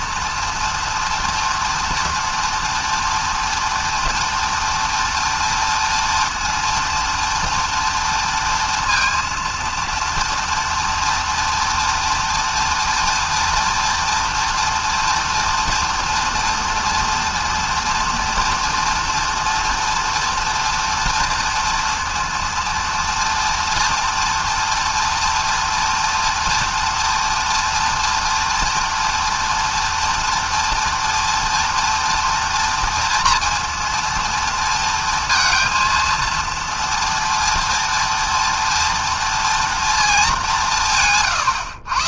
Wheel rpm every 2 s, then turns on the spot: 230, 230, 230, 240, 230, 230, 230, 230, 240, 230, 240, 230, 230, 230, 230, 230, 240, 230, 230, 230, 190.
none